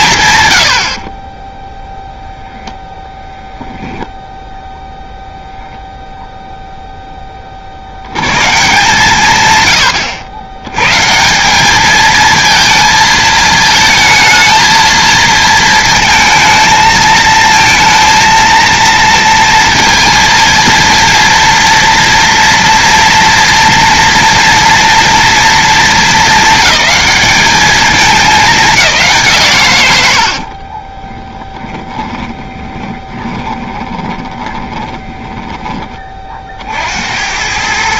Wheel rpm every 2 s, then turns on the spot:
120, 0, 0, 0, 160, 110, 220, 220, 220, 230, 230, 230, 230, 220, 190, 40, 20, 20, 60.
30-36